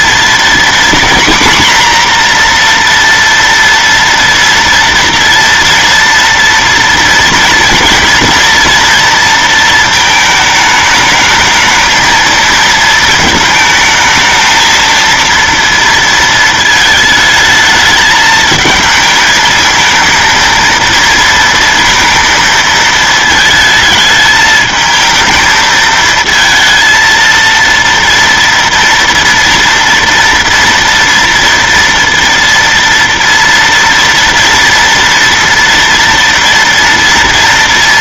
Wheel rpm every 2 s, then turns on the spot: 250, 240, 230, 230, 230, 220, 220, 230, 220, 220, 230, 220, 220, 230, 230, 230, 230, 230, 230.
none